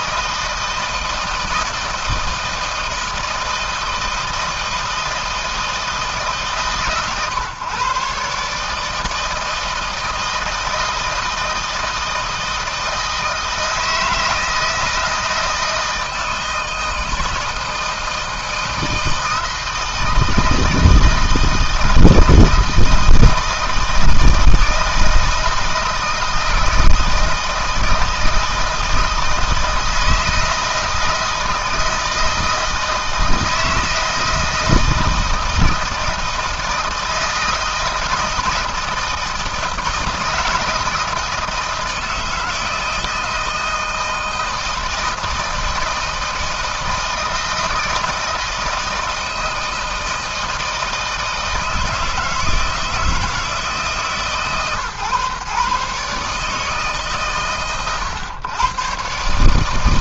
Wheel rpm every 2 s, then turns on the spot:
160, 160, 160, 130, 160, 160, 160, 160, 160, 160, 160, 160, 160, 160, 160, 170, 160, 160, 160, 160, 160, 160, 160, 160, 160, 160, 160, 140, 140, 120.
none